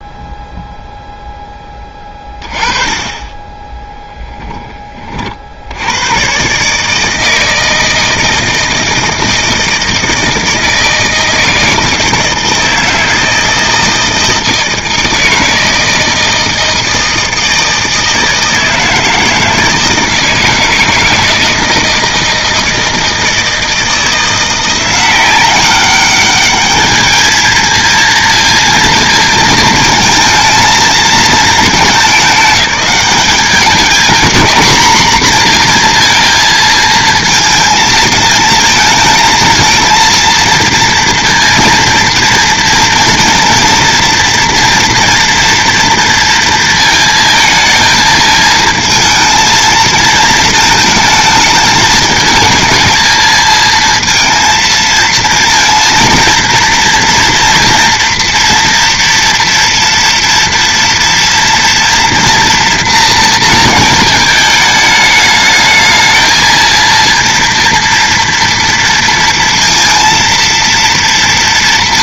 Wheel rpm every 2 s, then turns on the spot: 0, 20, 30, 150, 160, 160, 160, 160, 160, 160, 160, 160, 170, 210, 230, 220, 200, 230, 230, 220, 230, 230, 230, 230, 220, 220, 220, 230, 230, 230, 230, 230, 210, 230, 230, 230.
none